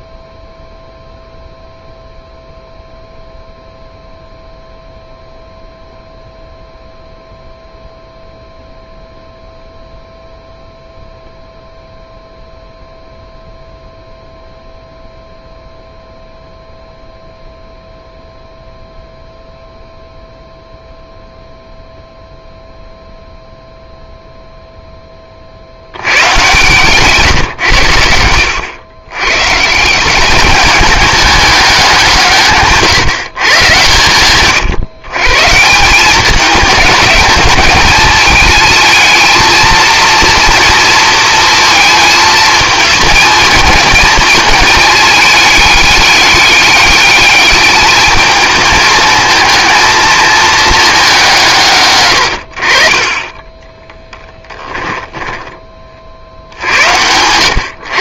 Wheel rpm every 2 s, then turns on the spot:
0, 0, 0, 0, 0, 0, 0, 0, 0, 0, 0, 0, 10, 140, 110, 210, 150, 120, 220, 220, 230, 220, 210, 210, 220, 210, 40, 10, 70.
26-28